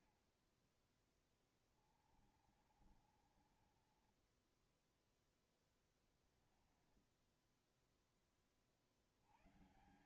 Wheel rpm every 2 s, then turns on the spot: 40, 30, 20, 10, 10.
2-6